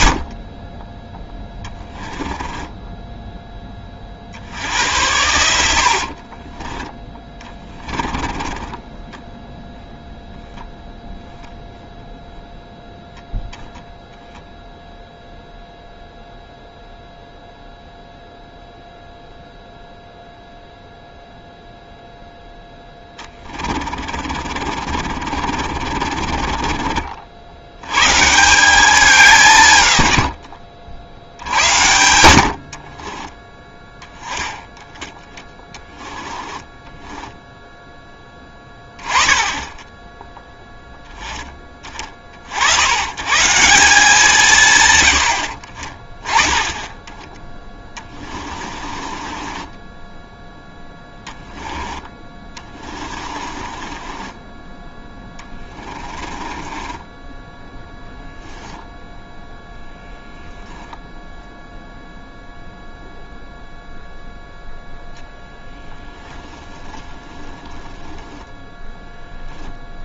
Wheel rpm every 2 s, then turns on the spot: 20, 10, 70, 30, 20, 0, 0, 0, 0, 0, 0, 0, 20, 30, 180, 70, 60, 10, 20, 10, 10, 60, 150, 20, 30, 10, 30, 20, 20, 10, 0, 0, 0, 10, 0.
2-4 6-10 24-28 30-32 36-38 48-50 52-58 66-68